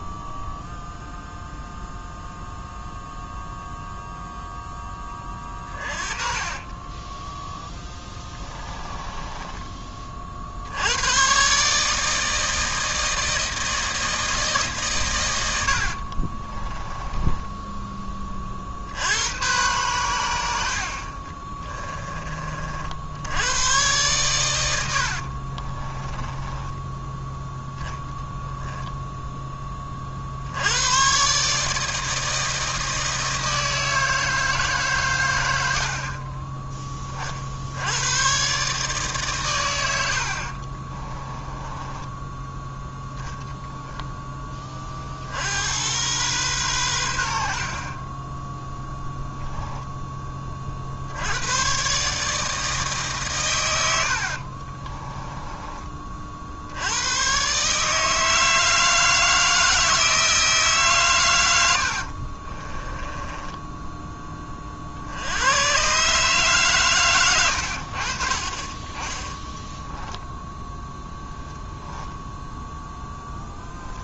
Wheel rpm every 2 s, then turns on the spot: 0, 0, 0, 20, 10, 90, 160, 150, 30, 60, 70, 50, 80, 10, 10, 100, 160, 140, 20, 140, 40, 0, 30, 110, 10, 50, 150, 40, 80, 160, 150, 20, 50, 140, 30, 0, 0.
6-10 16-18 26-30 40-42 48-50 54-56 62-64